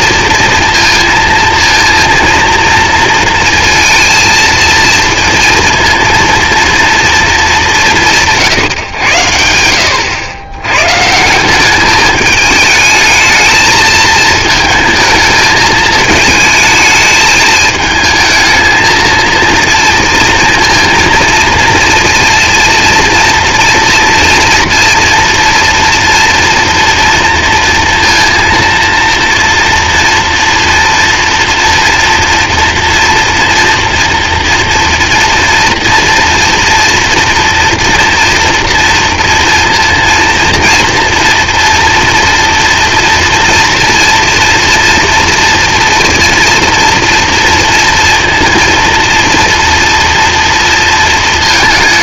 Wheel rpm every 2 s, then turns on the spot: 230, 230, 230, 230, 140, 110, 210, 220, 220, 220, 230, 230, 230, 240, 230, 230, 230, 230, 230, 230, 230, 240, 230, 230, 230, 230.
none